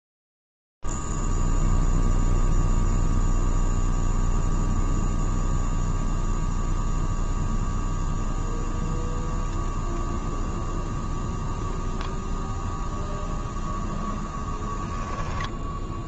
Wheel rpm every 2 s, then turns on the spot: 0, 0, 0, 0, 0, 0, 0, 10.
none